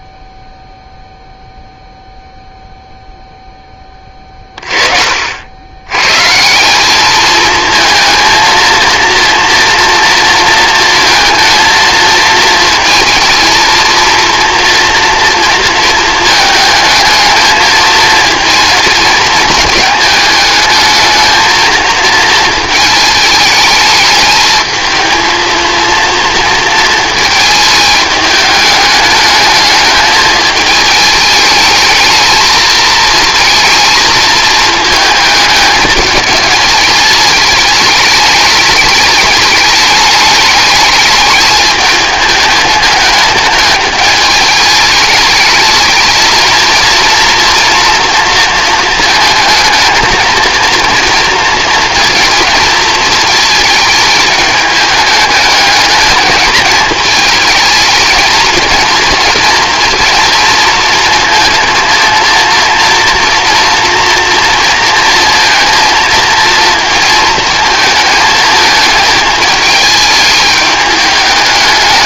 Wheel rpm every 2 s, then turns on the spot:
0, 0, 40, 190, 230, 230, 230, 230, 220, 220, 220, 220, 220, 230, 210, 210, 220, 220, 220, 210, 210, 210, 210, 230, 220, 230, 230, 210, 210, 230, 230, 230, 230, 220, 220, 210.
none